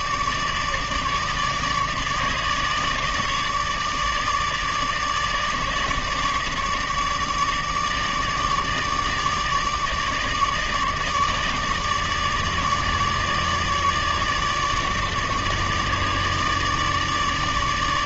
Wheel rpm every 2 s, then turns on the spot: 150, 150, 150, 150, 150, 150, 150, 150, 150.
none